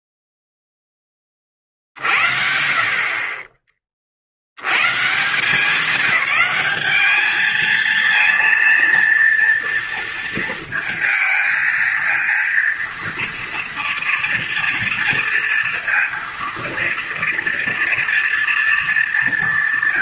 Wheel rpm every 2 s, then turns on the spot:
0, 40, 90, 210, 230, 230, 230, 230, 230, 220.
none